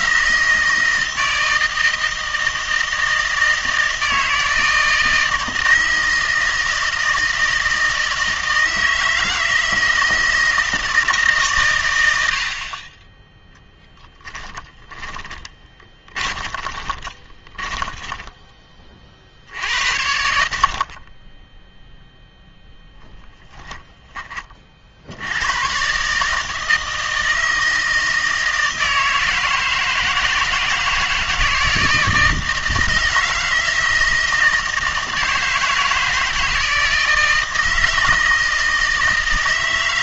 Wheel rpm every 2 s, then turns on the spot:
160, 160, 160, 160, 160, 160, 60, 10, 20, 20, 60, 0, 30, 160, 160, 160, 160, 160, 160, 160.
14-18